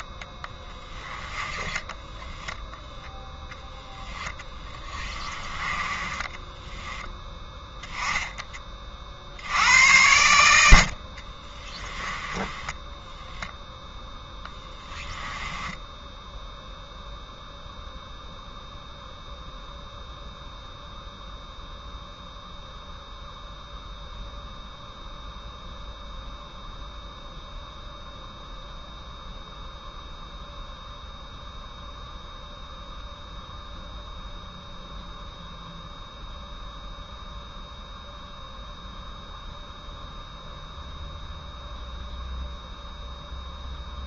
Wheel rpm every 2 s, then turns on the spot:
10, 0, 20, 10, 40, 60, 10, 10, 0, 0, 0, 0, 0, 0, 0, 0, 0, 0, 0, 0, 0, 0.
0-2 4-6 14-16